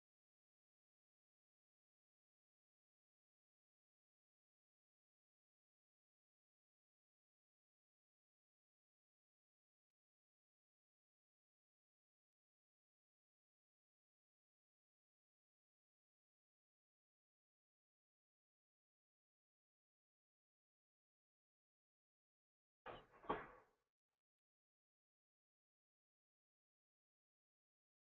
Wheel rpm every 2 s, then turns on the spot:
0, 0, 0, 0, 0, 0, 0, 0, 0, 0, 0, 0, 0, 0.
none